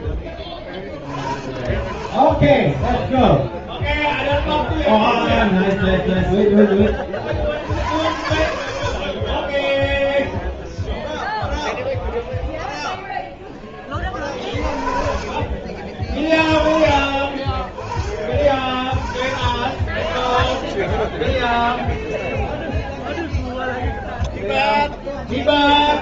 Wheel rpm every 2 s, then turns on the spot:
20, 30, 0, 10, 70, 10, 0, 40, 40, 50, 20, 10, 0.
10-12 20-24